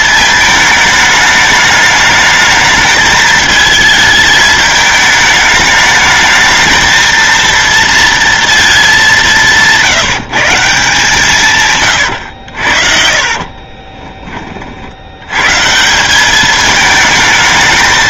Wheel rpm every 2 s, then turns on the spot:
220, 220, 210, 220, 210, 160, 60, 60, 220.
12-14